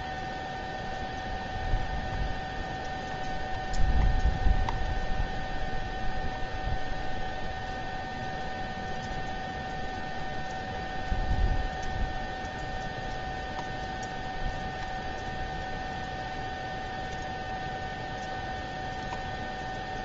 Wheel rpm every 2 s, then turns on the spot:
0, 0, 0, 0, 0, 0, 0, 0, 0, 0.
none